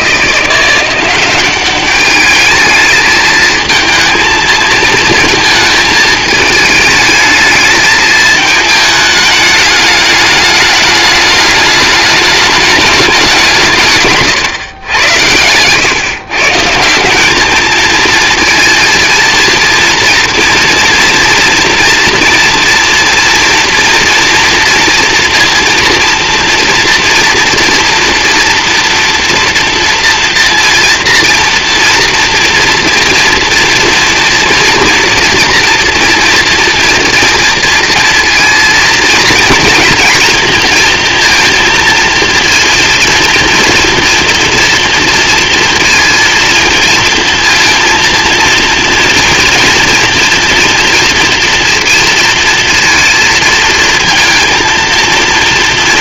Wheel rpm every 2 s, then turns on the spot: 180, 220, 230, 220, 220, 210, 220, 110, 150, 230, 230, 230, 230, 230, 230, 230, 230, 230, 230, 230, 230, 230, 230, 230, 230, 230, 230, 230.
none